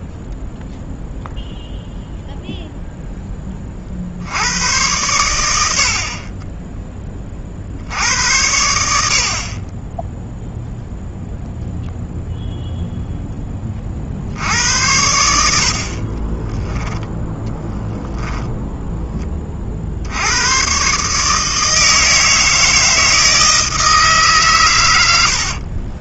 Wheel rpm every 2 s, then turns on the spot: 0, 0, 90, 10, 80, 0, 0, 70, 10, 10, 120, 160, 130.
18-20